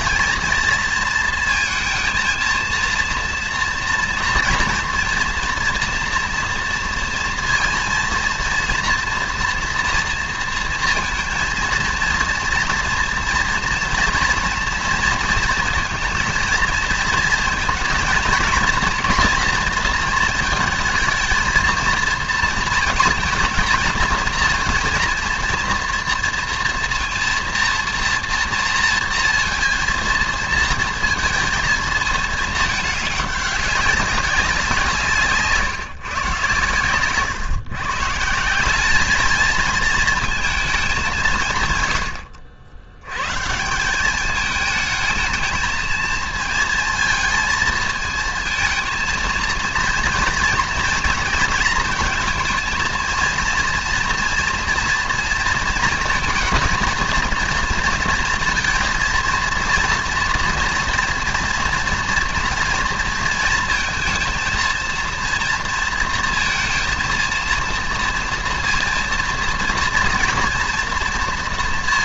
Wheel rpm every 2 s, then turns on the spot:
230, 230, 240, 230, 230, 230, 230, 230, 230, 230, 220, 230, 230, 230, 230, 230, 210, 180, 130, 190, 220, 70, 220, 230, 220, 230, 220, 230, 220, 230, 230, 230, 230, 230, 230, 240.
none